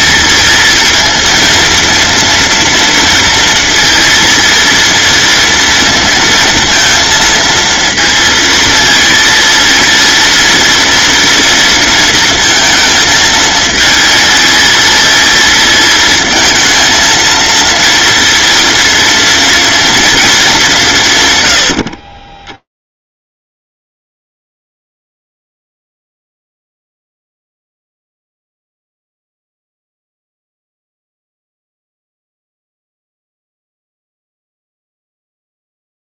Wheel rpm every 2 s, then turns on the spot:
220, 230, 230, 230, 230, 230, 220, 230, 230, 230, 150, 10, 0, 0, 0, 0, 0, 0.
none